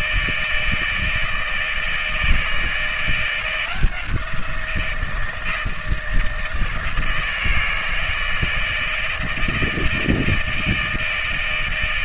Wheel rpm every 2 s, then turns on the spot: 160, 160, 170, 160, 160, 160.
none